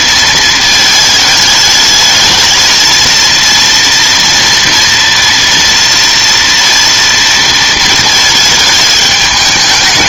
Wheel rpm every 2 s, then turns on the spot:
220, 220, 230, 230, 220.
none